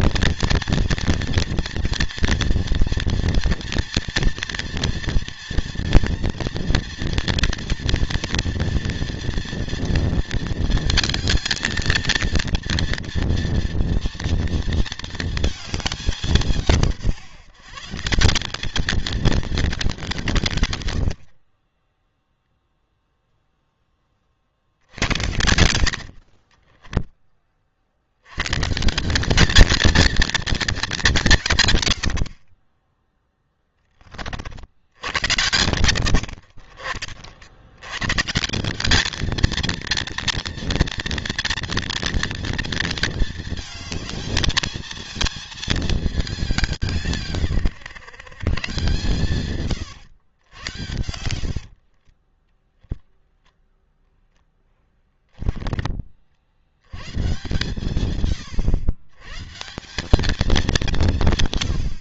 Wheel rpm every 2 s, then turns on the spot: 230, 230, 230, 230, 230, 230, 230, 230, 170, 210, 140, 0, 70, 30, 120, 220, 40, 50, 80, 170, 230, 230, 220, 200, 130, 100, 20, 0, 60, 120, 200.
26-28 52-54